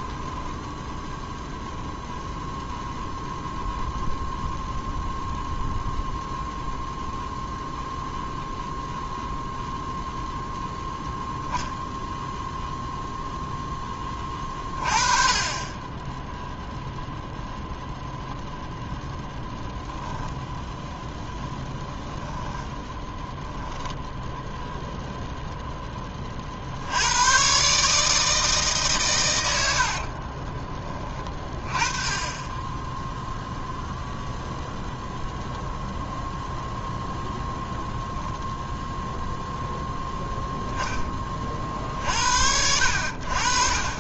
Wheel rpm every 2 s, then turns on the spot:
0, 0, 0, 0, 0, 10, 0, 30, 0, 0, 0, 10, 0, 70, 140, 20, 10, 0, 0, 0, 10, 70.
22-24